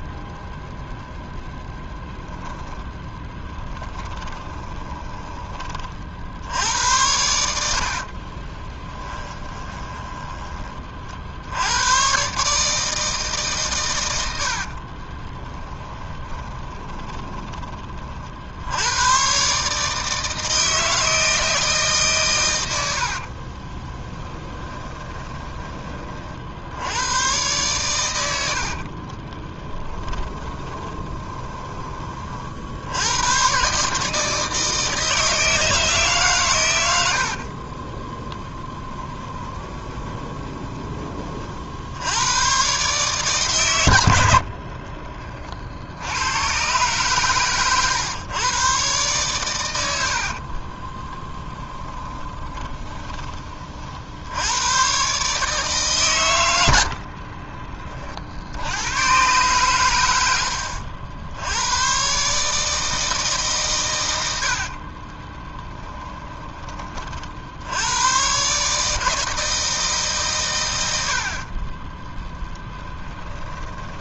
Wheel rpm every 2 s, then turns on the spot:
0, 0, 20, 90, 20, 40, 150, 50, 20, 80, 160, 90, 20, 80, 60, 20, 70, 160, 110, 10, 20, 120, 40, 120, 130, 20, 20, 100, 80, 100, 70, 160, 60, 30, 150, 110, 10.
4-6 8-10 14-18 24-26 28-32 38-40 44-46 50-54 64-66